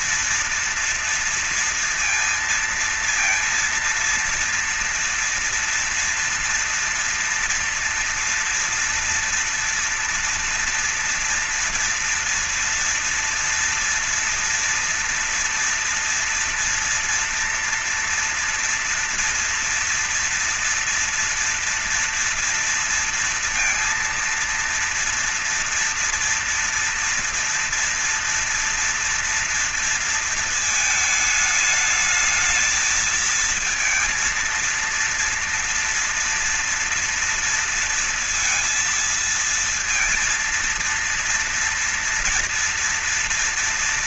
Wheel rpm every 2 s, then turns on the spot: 230, 230, 230, 230, 230, 230, 240, 230, 230, 230, 230, 230, 230, 230, 230, 220, 220, 230, 240, 230, 230, 230.
none